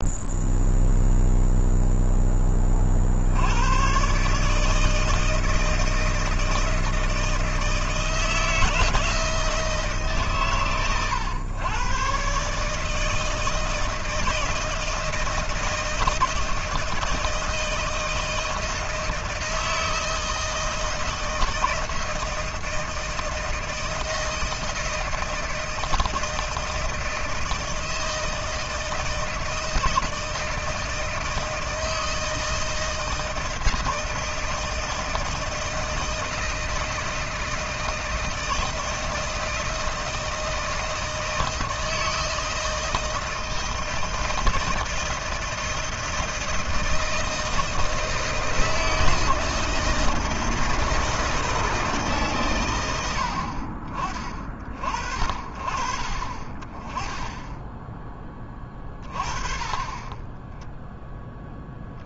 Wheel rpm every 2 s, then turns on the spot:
0, 20, 150, 160, 160, 130, 140, 160, 160, 160, 160, 160, 160, 160, 160, 160, 160, 160, 160, 160, 160, 160, 160, 160, 160, 160, 110, 40, 20, 20, 10.
none